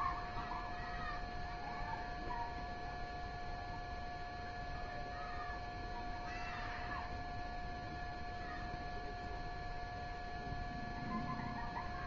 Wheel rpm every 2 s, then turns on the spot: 0, 0, 0, 0, 0, 0.
none